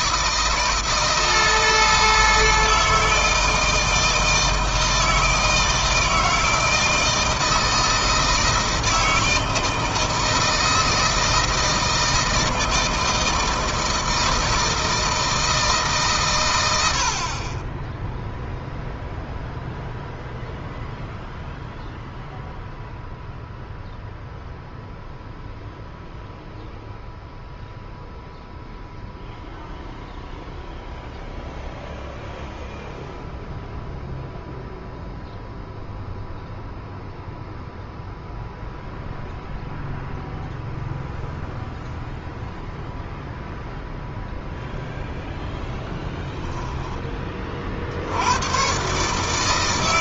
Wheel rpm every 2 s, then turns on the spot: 160, 160, 160, 160, 160, 160, 160, 160, 100, 0, 0, 0, 0, 0, 0, 0, 0, 0, 0, 0, 0, 0, 0, 10, 120.
none